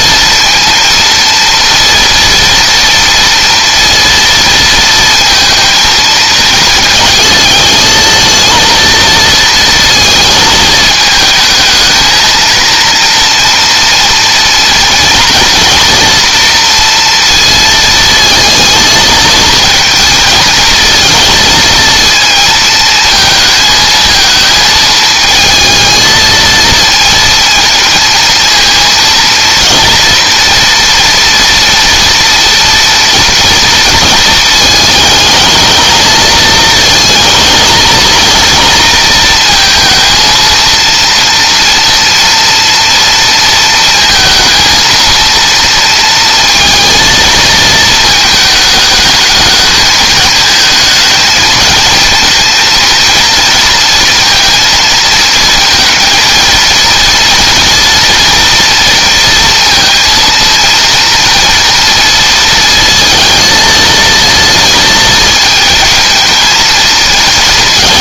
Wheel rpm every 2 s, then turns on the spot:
230, 230, 230, 220, 230, 220, 230, 230, 230, 220, 220, 220, 220, 220, 230, 240, 240, 220, 220, 230, 230, 230, 230, 230, 220, 220, 230, 230, 230, 230, 230, 230, 220, 230.
none